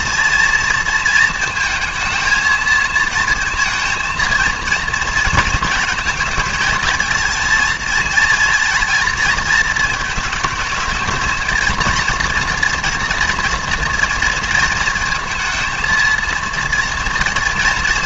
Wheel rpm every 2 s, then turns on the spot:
230, 220, 230, 220, 230, 210, 230, 230, 230.
none